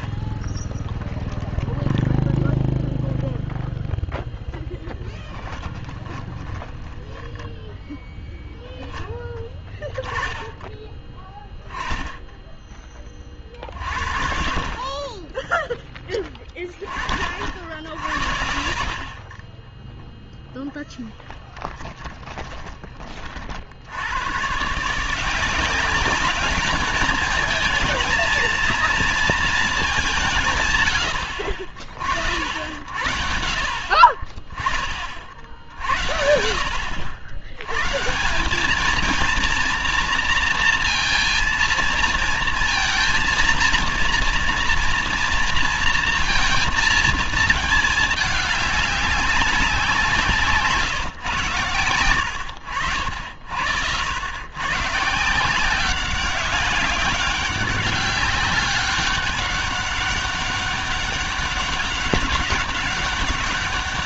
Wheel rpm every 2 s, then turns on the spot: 10, 0, 10, 10, 0, 10, 10, 40, 10, 50, 0, 10, 120, 200, 230, 140, 70, 30, 70, 180, 230, 230, 230, 230, 210, 170, 90, 110, 190, 200, 200, 200.
0-2 6-8 18-20